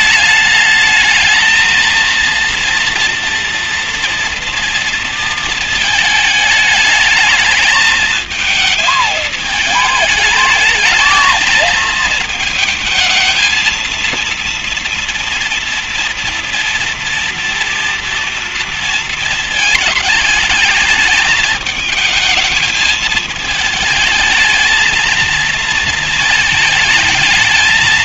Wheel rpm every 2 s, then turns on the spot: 210, 230, 230, 210, 220, 210, 220, 230, 230, 230, 220, 220, 220, 220.
none